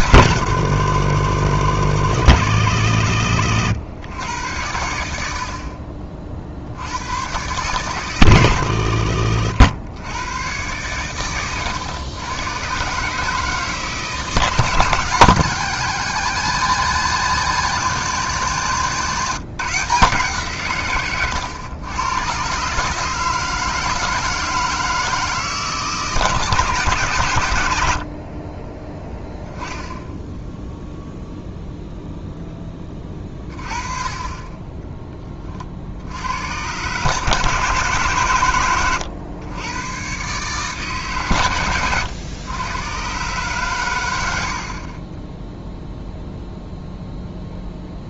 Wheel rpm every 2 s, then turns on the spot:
110, 80, 90, 60, 110, 110, 120, 160, 180, 170, 150, 130, 160, 150, 30, 0, 0, 20, 100, 120, 140, 110, 60, 0.
none